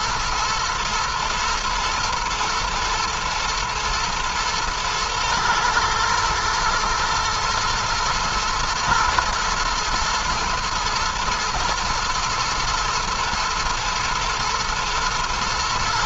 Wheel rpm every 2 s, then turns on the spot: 120, 110, 120, 110, 120, 120, 120, 110.
none